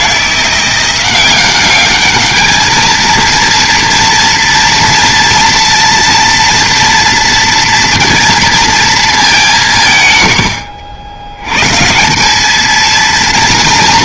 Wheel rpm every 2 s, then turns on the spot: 180, 220, 230, 230, 230, 80, 230.
none